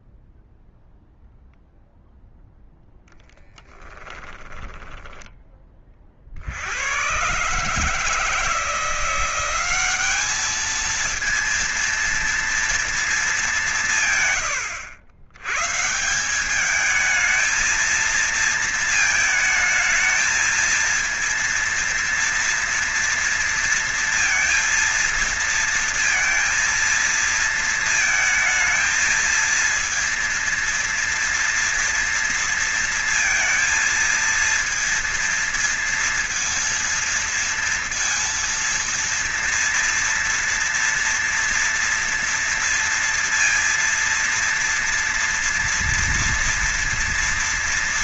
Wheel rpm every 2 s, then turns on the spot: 0, 10, 20, 110, 170, 220, 210, 100, 220, 220, 230, 230, 230, 230, 230, 230, 230, 230, 230, 230, 230, 230, 230, 230.
2-4